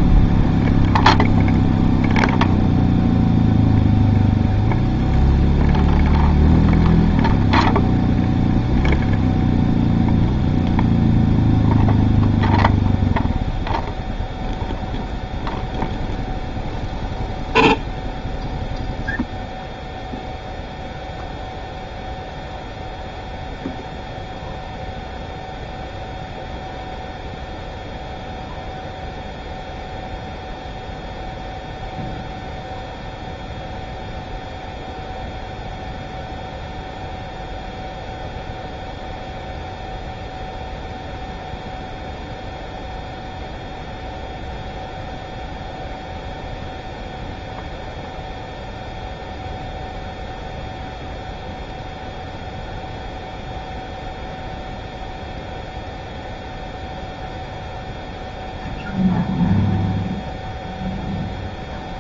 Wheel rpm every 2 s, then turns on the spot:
0, 0, 0, 0, 0, 0, 0, 0, 0, 0, 0, 0, 0, 0, 0, 0, 0, 0, 0, 0, 0, 0, 0, 0, 0, 0, 0, 0, 0, 0, 0.
none